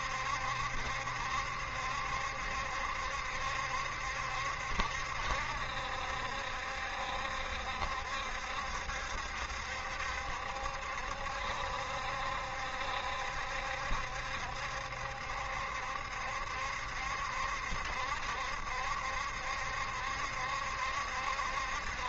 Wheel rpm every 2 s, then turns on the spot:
70, 70, 70, 70, 70, 70, 70, 70, 70, 70, 70.
none